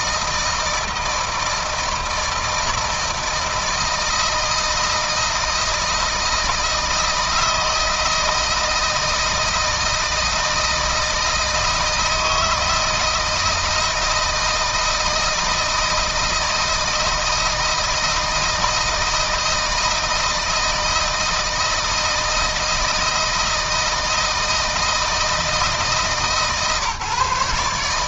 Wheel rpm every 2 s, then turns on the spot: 160, 160, 160, 160, 160, 160, 160, 160, 160, 160, 160, 160, 160, 150.
none